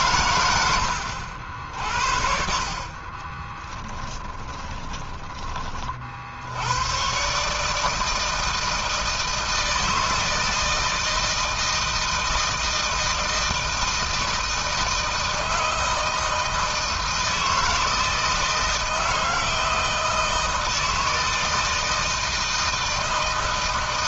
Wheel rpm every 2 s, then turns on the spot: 120, 60, 20, 70, 160, 160, 160, 160, 160, 160, 160, 160.
4-6